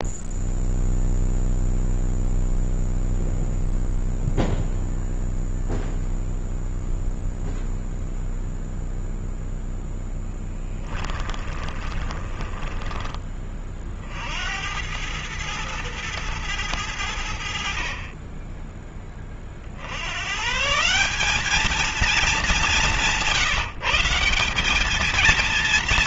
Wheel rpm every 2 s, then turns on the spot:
0, 0, 0, 0, 0, 10, 20, 90, 90, 20, 160, 200, 190.
10-14